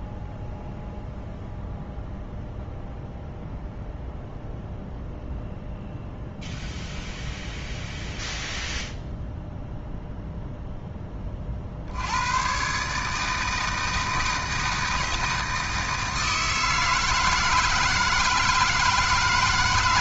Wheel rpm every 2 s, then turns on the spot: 0, 0, 0, 0, 0, 10, 140, 160, 160, 160.
none